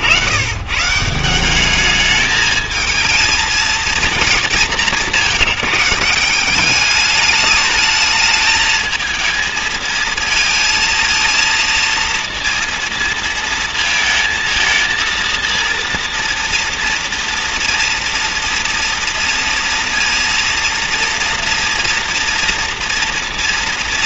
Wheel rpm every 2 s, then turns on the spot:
130, 220, 200, 200, 220, 230, 230, 220, 240, 240, 230, 240.
none